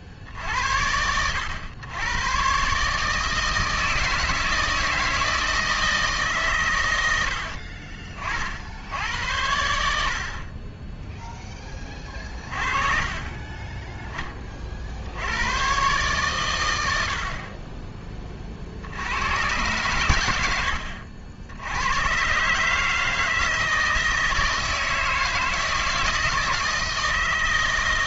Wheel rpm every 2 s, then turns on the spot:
50, 120, 160, 140, 50, 30, 30, 30, 110, 30, 90, 140, 160, 160.
none